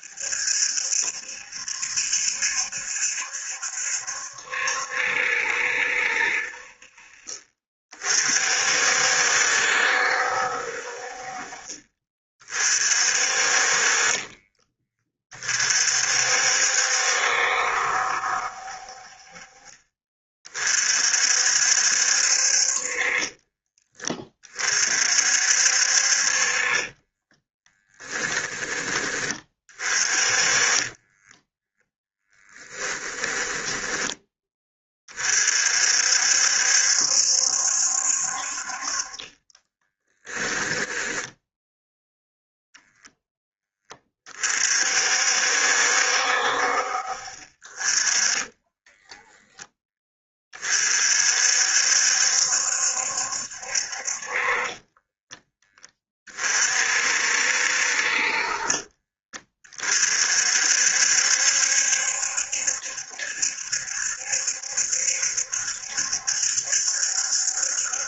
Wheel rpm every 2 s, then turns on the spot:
70, 70, 70, 50, 60, 50, 40, 30, 70, 50, 50, 30, 50, 20, 20, 20, 20, 30, 70, 40, 10, 0, 50, 50, 20, 50, 70, 20, 60, 30, 60, 70, 70, 70.
26-28 30-34 40-42 48-50 54-56